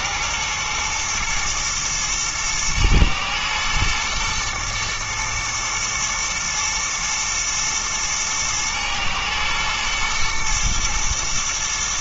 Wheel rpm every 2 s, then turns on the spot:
110, 110, 110, 120, 110, 110.
none